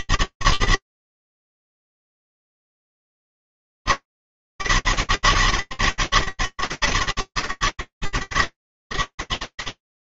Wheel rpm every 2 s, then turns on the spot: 200, 200, 200, 190, 140.
none